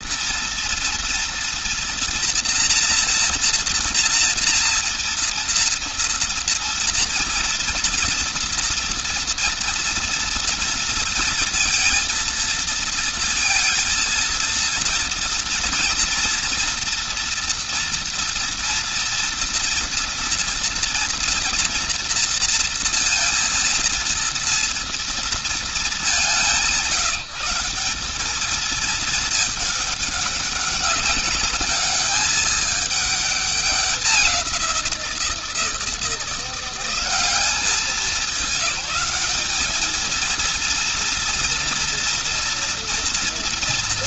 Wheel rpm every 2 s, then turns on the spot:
230, 240, 240, 230, 230, 230, 230, 230, 240, 230, 230, 230, 230, 200, 210, 200, 210, 190, 170, 200, 230, 230.
none